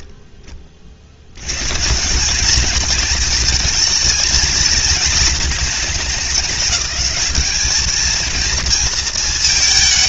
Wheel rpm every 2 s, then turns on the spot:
40, 230, 240, 200, 230.
none